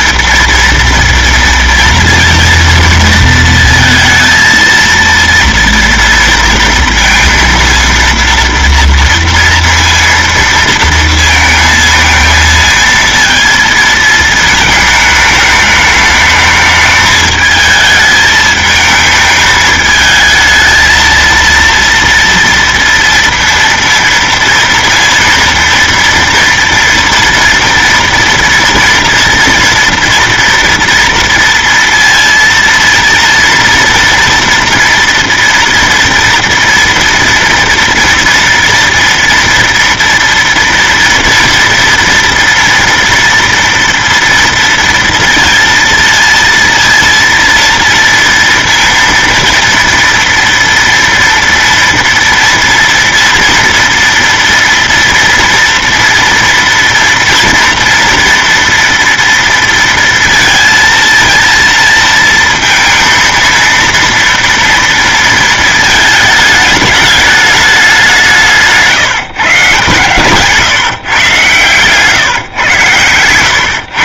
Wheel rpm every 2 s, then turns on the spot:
240, 230, 230, 230, 230, 230, 230, 220, 210, 220, 220, 230, 230, 240, 230, 230, 230, 230, 240, 230, 230, 230, 230, 230, 230, 230, 230, 230, 230, 230, 230, 230, 230, 210, 150, 140, 120.
none